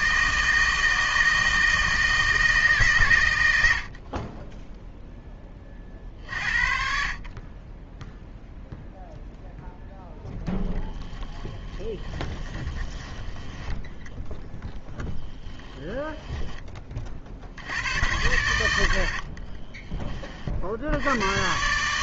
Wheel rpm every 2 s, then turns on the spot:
160, 140, 10, 50, 0, 20, 20, 10, 20, 90, 70.
10-14